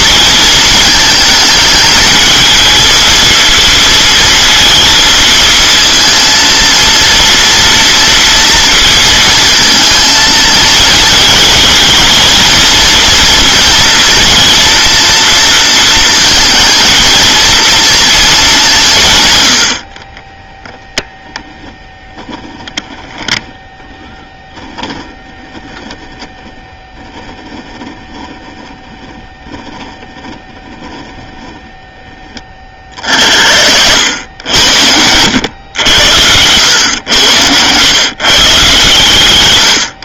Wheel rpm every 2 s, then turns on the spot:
220, 220, 230, 230, 230, 220, 230, 230, 230, 170, 0, 10, 10, 10, 10, 10, 40, 90, 110, 140.
none